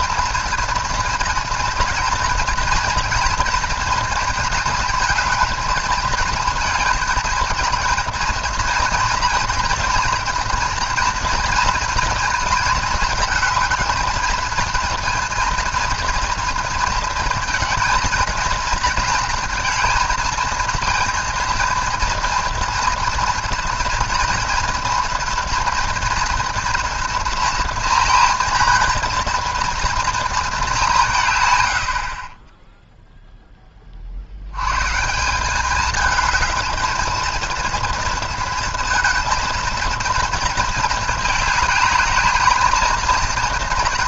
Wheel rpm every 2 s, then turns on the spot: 230, 230, 230, 220, 230, 240, 230, 220, 230, 230, 230, 230, 230, 230, 230, 220, 30, 80, 220, 230, 230, 220.
none